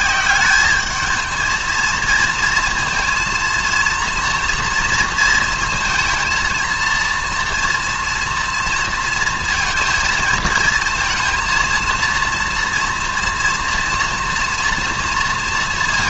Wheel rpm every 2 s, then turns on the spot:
200, 230, 230, 230, 230, 230, 230, 230.
none